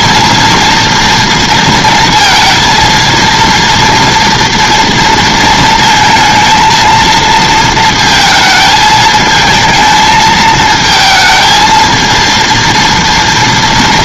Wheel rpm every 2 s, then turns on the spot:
230, 230, 230, 230, 220, 220, 230.
none